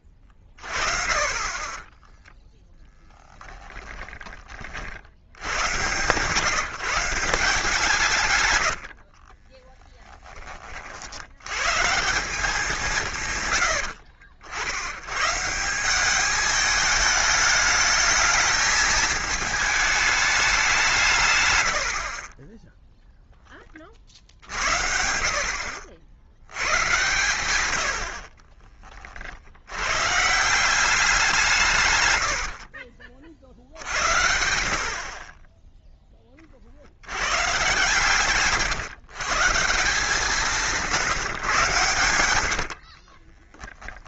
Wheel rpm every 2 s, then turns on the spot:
40, 0, 40, 150, 100, 30, 170, 80, 220, 220, 190, 10, 50, 90, 30, 150, 80, 70, 40, 150, 160, 70.
8-10 28-30 32-34 42-44